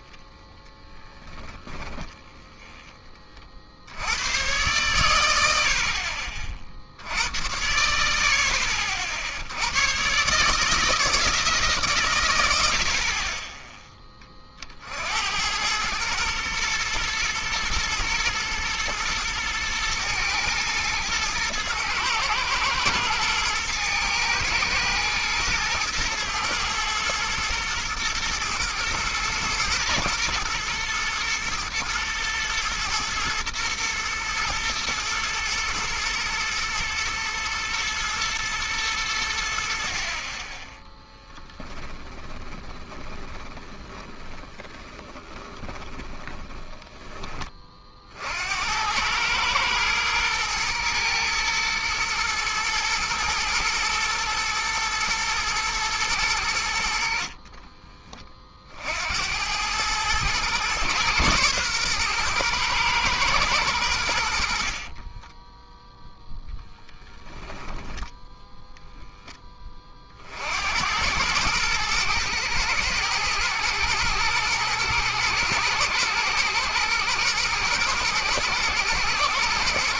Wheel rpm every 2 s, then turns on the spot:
10, 10, 120, 60, 50, 150, 70, 50, 110, 110, 110, 110, 110, 110, 110, 120, 110, 110, 110, 110, 20, 20, 20, 20, 80, 120, 110, 110, 70, 50, 110, 120, 50, 10, 0, 70, 110, 110, 120, 120.
0-2 42-48 64-66